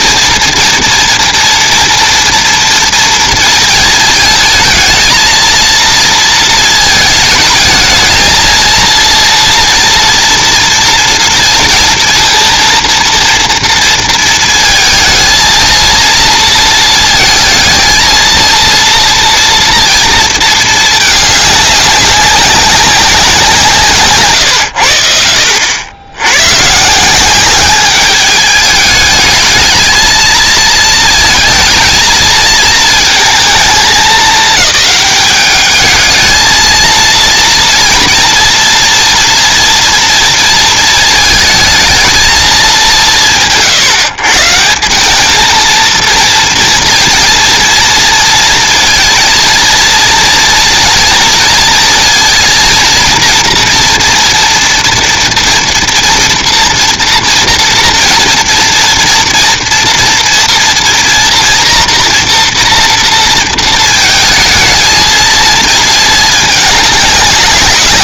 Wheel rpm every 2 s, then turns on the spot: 230, 230, 230, 220, 230, 230, 230, 220, 220, 230, 210, 180, 70, 180, 210, 230, 220, 210, 230, 230, 220, 140, 200, 230, 230, 230, 240, 230, 240, 230, 240, 230, 220, 200.
none